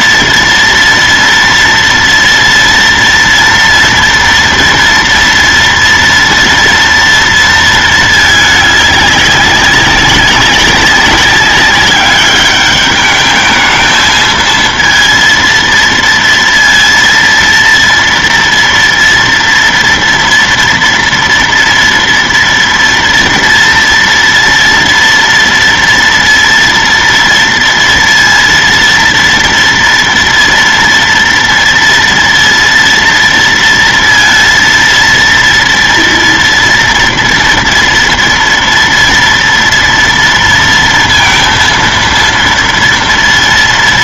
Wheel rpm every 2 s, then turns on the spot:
230, 230, 230, 230, 210, 190, 210, 230, 230, 230, 240, 230, 230, 230, 230, 230, 230, 230, 230, 230, 230, 230.
none